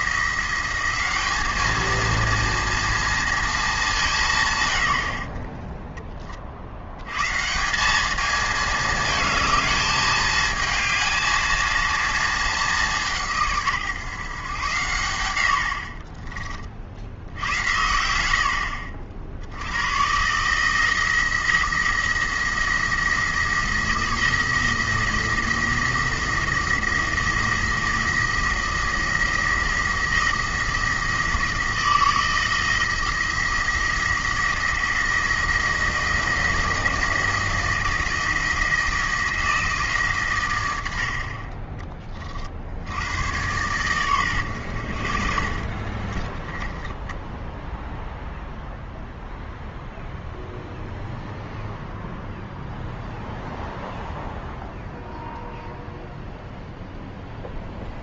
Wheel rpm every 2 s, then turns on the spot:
190, 230, 110, 70, 220, 220, 200, 110, 50, 70, 160, 170, 170, 170, 170, 170, 170, 170, 170, 160, 100, 60, 80, 10, 0, 0, 0, 0, 0.
46-48